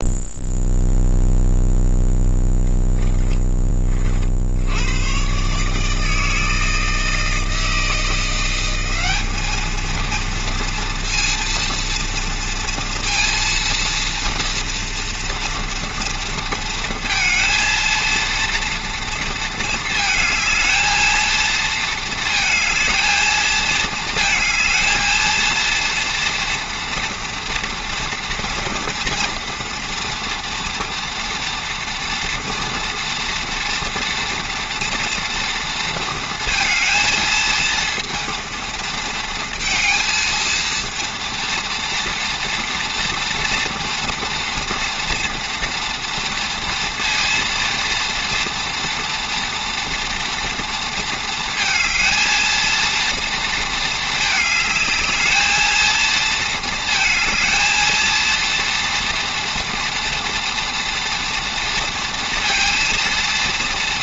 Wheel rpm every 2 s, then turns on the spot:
0, 0, 60, 160, 170, 230, 230, 230, 230, 230, 220, 220, 220, 230, 230, 230, 230, 230, 220, 230, 230, 230, 230, 230, 230, 230, 220, 220, 230, 230, 230, 230.
none